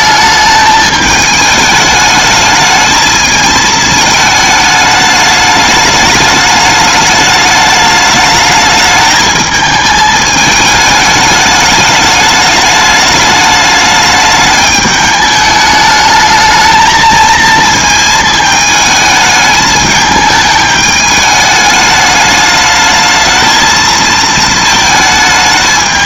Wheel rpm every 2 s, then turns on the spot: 220, 210, 220, 210, 210, 210, 210, 210, 220, 220, 210, 210, 220.
none